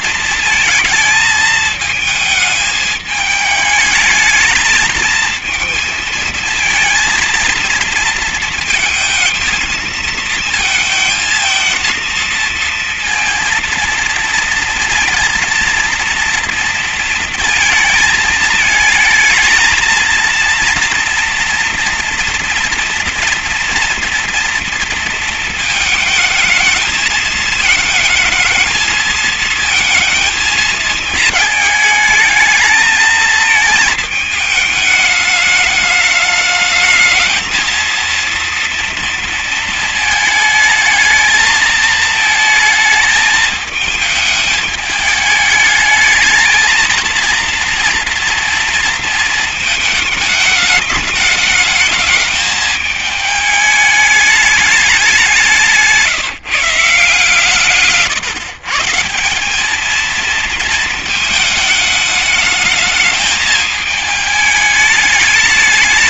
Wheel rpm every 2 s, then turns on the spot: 220, 210, 230, 230, 220, 230, 230, 230, 230, 220, 230, 230, 220, 220, 220, 220, 220, 210, 220, 230, 220, 220, 210, 230, 230, 220, 220, 200, 150, 170, 220, 210, 210.
none